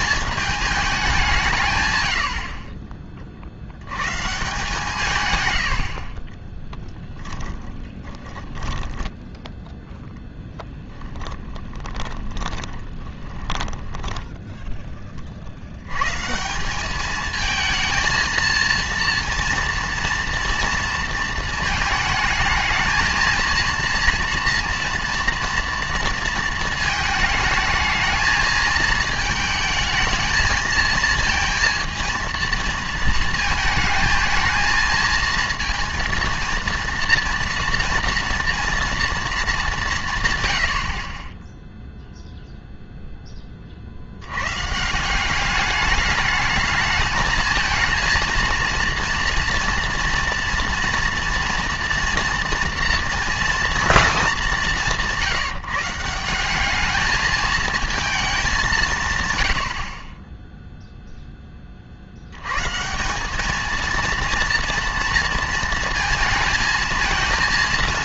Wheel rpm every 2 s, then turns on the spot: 220, 40, 160, 10, 10, 10, 20, 10, 180, 230, 230, 220, 230, 220, 220, 220, 230, 230, 230, 230, 90, 0, 130, 210, 230, 230, 230, 180, 200, 180, 0, 130, 230, 230.
6-16